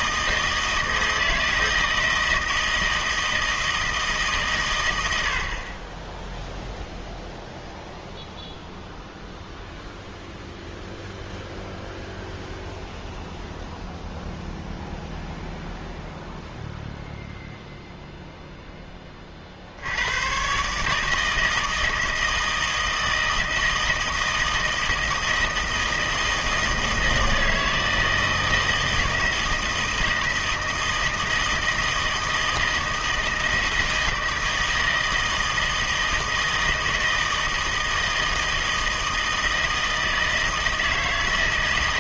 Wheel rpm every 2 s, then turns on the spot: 160, 160, 130, 0, 0, 0, 0, 0, 0, 0, 140, 160, 160, 160, 160, 160, 160, 160, 160, 160, 160.
none